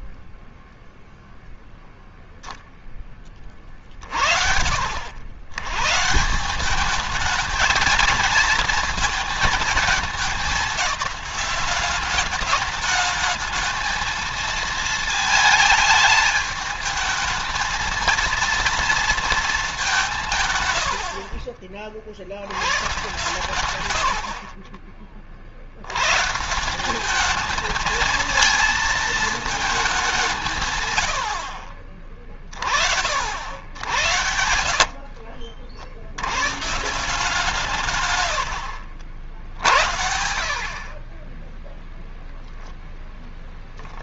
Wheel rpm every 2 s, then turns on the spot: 0, 10, 70, 190, 220, 210, 210, 220, 220, 230, 120, 110, 40, 170, 220, 160, 30, 70, 130, 70, 50, 0.
20-22 34-36